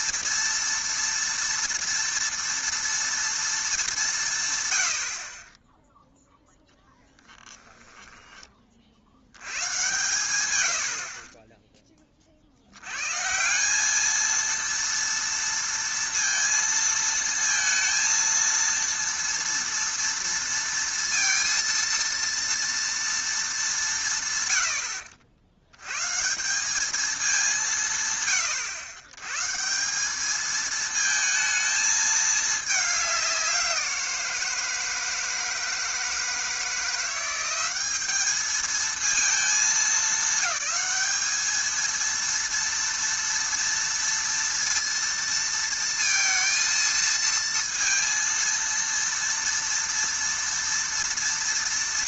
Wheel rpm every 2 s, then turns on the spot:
230, 230, 100, 0, 40, 90, 80, 230, 230, 230, 230, 230, 90, 190, 100, 220, 210, 160, 170, 220, 220, 230, 230, 230, 230, 230.
10-12